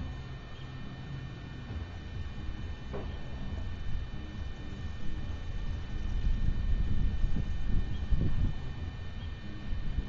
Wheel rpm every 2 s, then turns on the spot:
0, 0, 0, 0, 0.
none